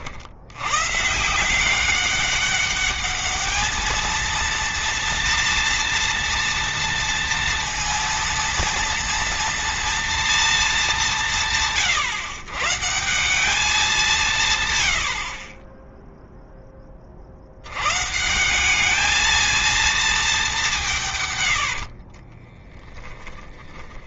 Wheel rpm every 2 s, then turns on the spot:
130, 210, 230, 230, 230, 200, 160, 100, 30, 210, 160, 10.
none